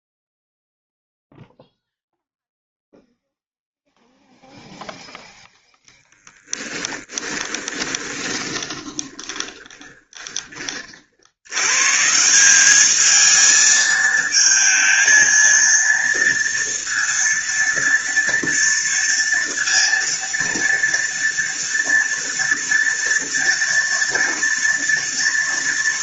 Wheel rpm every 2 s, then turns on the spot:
0, 0, 0, 10, 20, 40, 200, 220, 230, 230, 230, 230, 230.
6-10